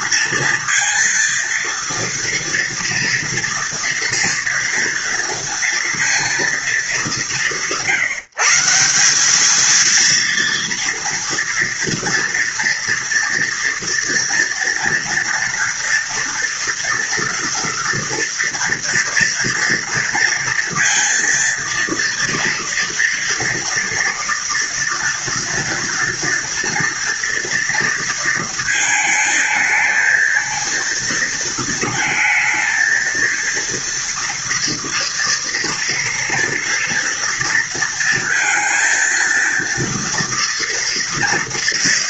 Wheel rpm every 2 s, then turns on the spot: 230, 230, 240, 210, 160, 230, 230, 230, 230, 230, 230, 230, 230, 230, 230, 230, 230, 230, 230, 230, 230.
none